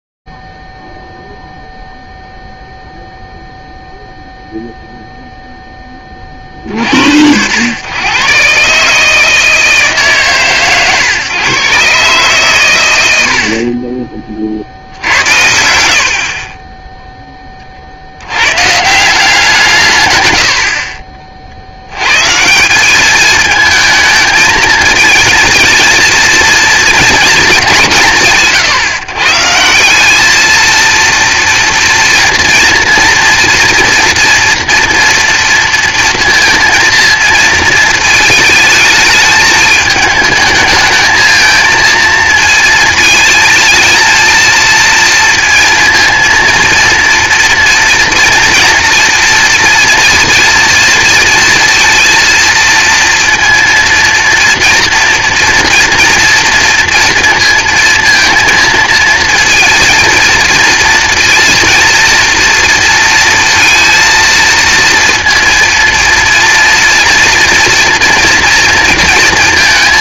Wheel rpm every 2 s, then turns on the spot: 0, 0, 0, 20, 110, 160, 140, 50, 70, 80, 130, 140, 220, 230, 160, 210, 240, 240, 230, 220, 220, 230, 220, 230, 230, 230, 230, 230, 230, 230, 230, 230, 230, 230, 230.
16-18